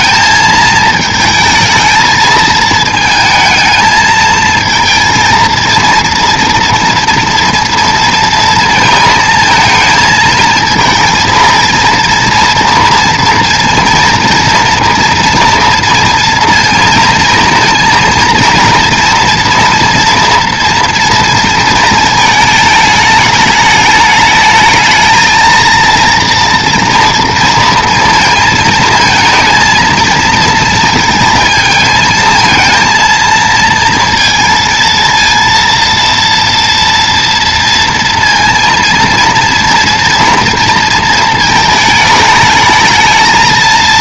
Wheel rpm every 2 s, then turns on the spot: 220, 220, 220, 230, 230, 230, 230, 230, 230, 230, 240, 220, 220, 230, 230, 230, 230, 230, 230, 230, 230, 210.
none